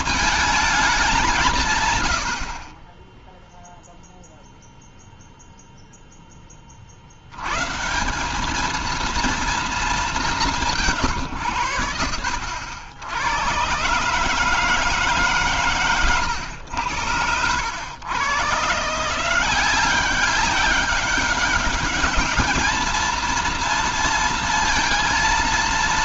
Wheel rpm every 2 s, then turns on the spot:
220, 80, 0, 30, 210, 190, 70, 150, 100, 130, 200, 210, 230.
none